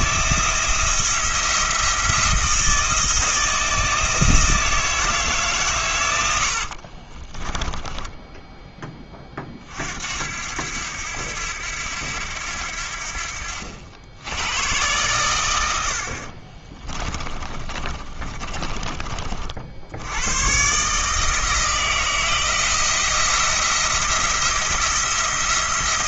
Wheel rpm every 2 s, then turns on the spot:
170, 160, 160, 50, 20, 80, 70, 110, 30, 20, 140, 170, 170.
6-8 16-20